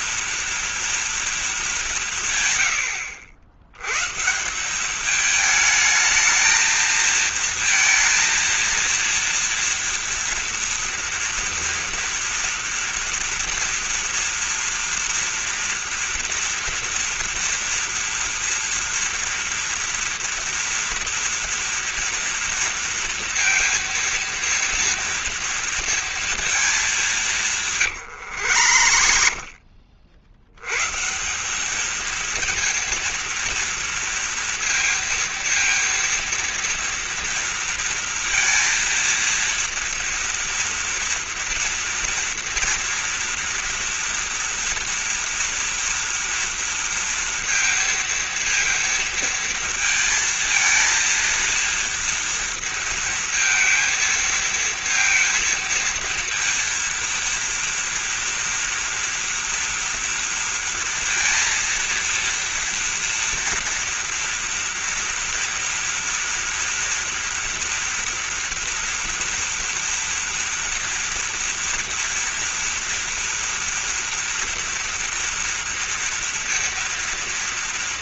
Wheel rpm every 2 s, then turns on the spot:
230, 120, 170, 220, 230, 230, 230, 230, 230, 230, 230, 230, 230, 220, 100, 90, 230, 230, 230, 230, 230, 230, 230, 230, 230, 230, 230, 230, 230, 230, 230, 230, 230, 230, 230, 230, 230, 230, 230.
28-30